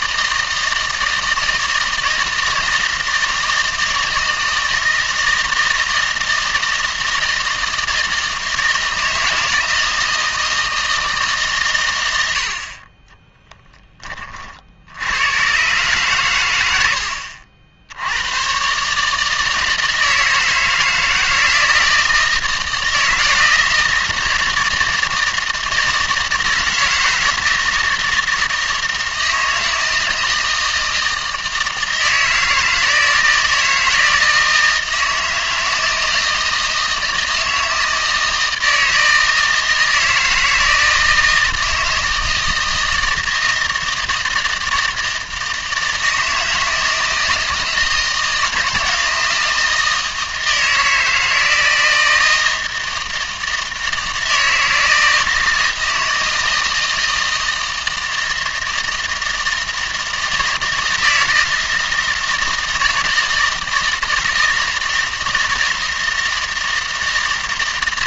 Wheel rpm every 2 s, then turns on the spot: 160, 160, 160, 160, 160, 160, 50, 60, 90, 130, 160, 160, 160, 160, 160, 160, 160, 160, 160, 160, 160, 160, 160, 160, 170, 160, 160, 160, 160, 160, 160, 160, 160, 160.
none